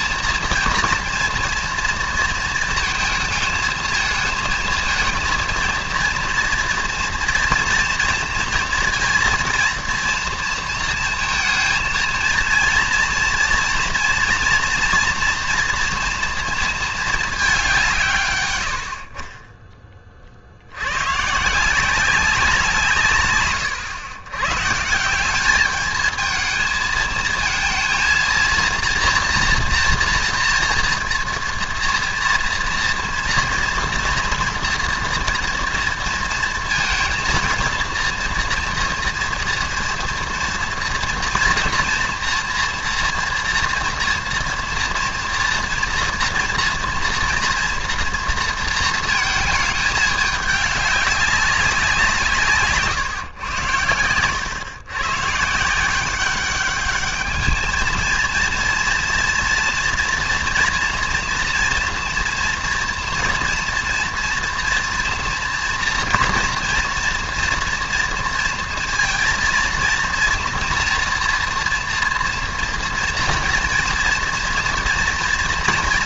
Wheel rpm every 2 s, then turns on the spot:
230, 230, 220, 230, 230, 230, 230, 230, 230, 90, 90, 160, 150, 220, 230, 230, 230, 230, 230, 230, 240, 230, 230, 230, 230, 210, 150, 120, 200, 230, 230, 230, 230, 230, 230, 240, 230, 230.
none